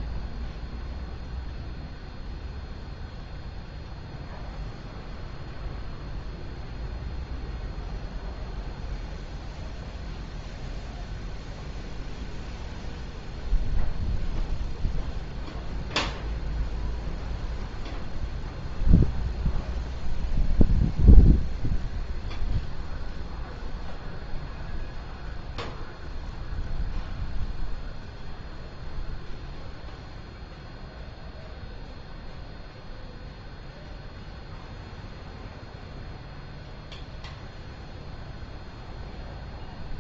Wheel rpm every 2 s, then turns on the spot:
0, 0, 0, 0, 0, 0, 0, 0, 0, 0, 0, 0, 0, 0, 0, 0, 0, 0, 0, 0.
none